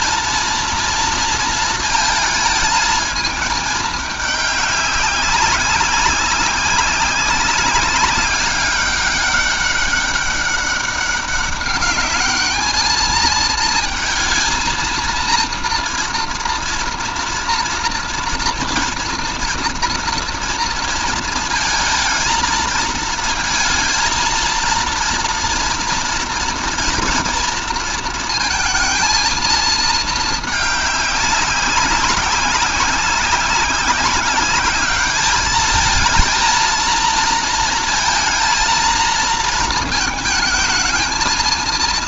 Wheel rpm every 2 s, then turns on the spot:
230, 220, 200, 200, 200, 200, 220, 230, 230, 230, 230, 230, 230, 230, 220, 200, 190, 200, 230, 230, 220.
none